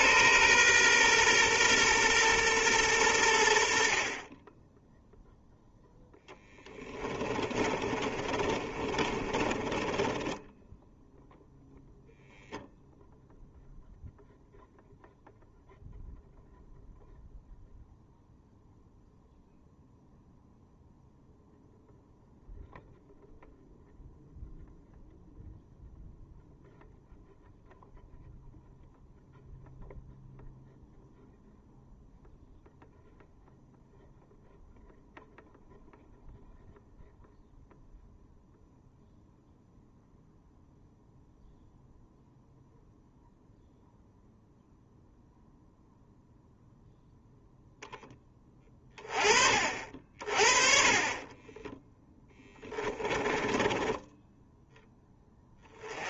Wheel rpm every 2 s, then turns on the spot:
120, 110, 10, 20, 40, 10, 0, 0, 0, 0, 0, 0, 0, 0, 0, 0, 0, 0, 0, 0, 0, 0, 0, 0, 20, 40, 20, 10.
6-12 52-54